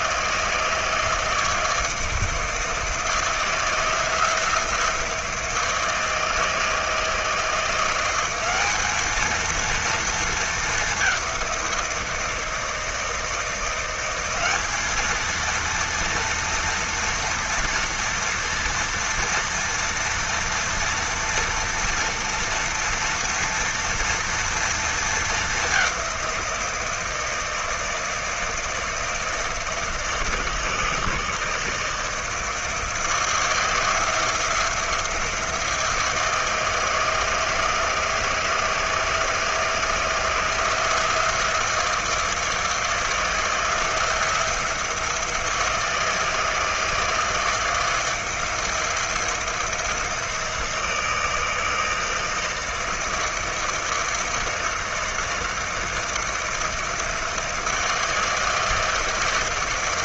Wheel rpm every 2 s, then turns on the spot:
160, 160, 170, 160, 210, 200, 160, 210, 230, 240, 230, 230, 230, 170, 160, 160, 160, 170, 160, 160, 170, 160, 170, 160, 170, 170, 160, 160, 160, 160.
none